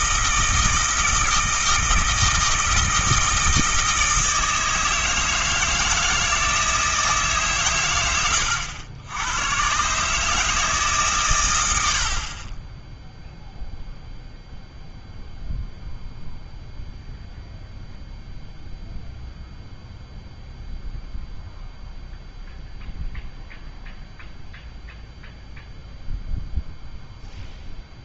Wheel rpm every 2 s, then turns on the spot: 160, 160, 160, 160, 80, 150, 10, 0, 0, 0, 0, 0, 0, 0.
none